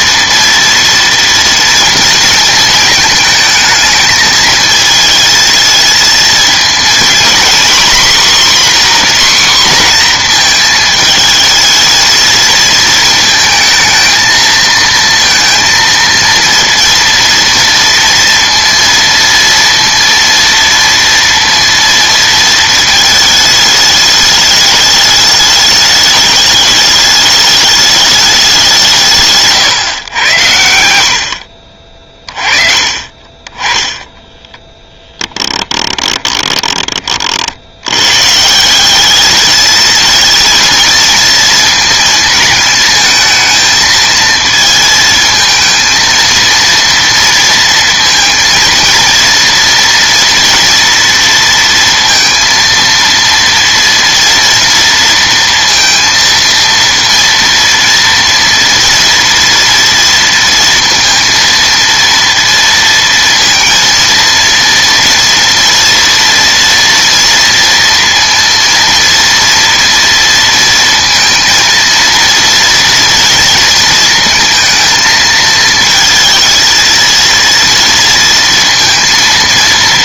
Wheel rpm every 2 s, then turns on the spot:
230, 220, 220, 230, 260, 220, 220, 230, 230, 230, 230, 220, 210, 210, 160, 70, 40, 10, 30, 190, 230, 220, 220, 230, 230, 230, 230, 230, 230, 230, 230, 230, 230, 230, 230, 230, 230, 220, 230, 230.
none